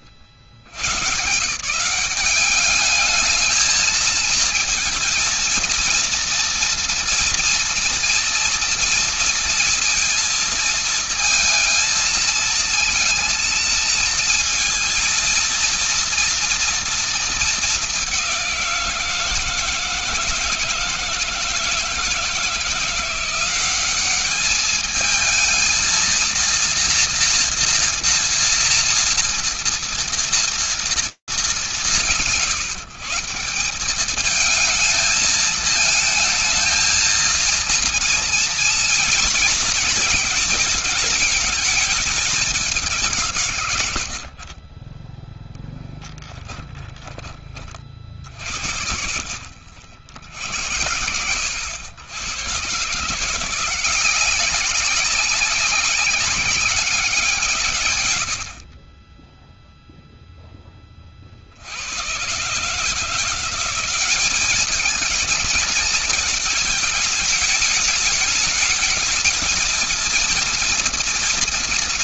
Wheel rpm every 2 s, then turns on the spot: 80, 210, 220, 230, 230, 220, 220, 230, 230, 180, 160, 160, 210, 230, 230, 210, 170, 220, 220, 240, 210, 160, 10, 20, 40, 80, 160, 200, 170, 10, 30, 160, 220, 220, 220, 230.
none